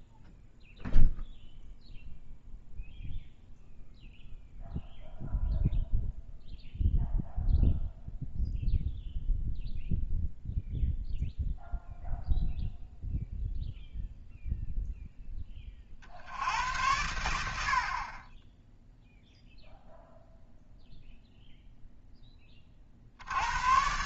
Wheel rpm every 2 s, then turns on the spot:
0, 0, 0, 0, 0, 0, 0, 0, 90, 10, 0, 30.
none